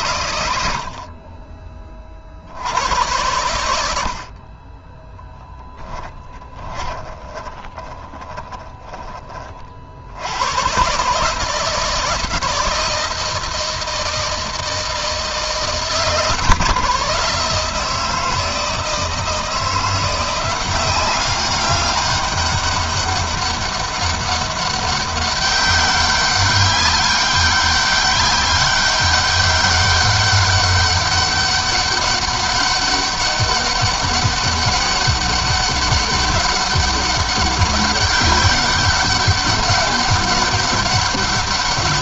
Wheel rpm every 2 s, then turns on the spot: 40, 80, 10, 20, 20, 140, 160, 150, 130, 160, 190, 200, 200, 200, 200, 200, 200, 200, 200, 200, 200.
4-8